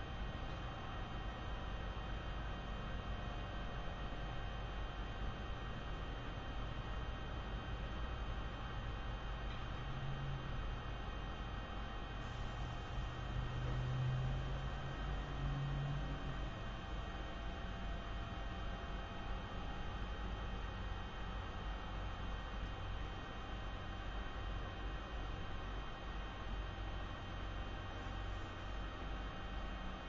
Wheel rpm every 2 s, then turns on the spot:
0, 0, 0, 0, 0, 0, 0, 0, 0, 0, 0, 0, 0, 0, 0.
none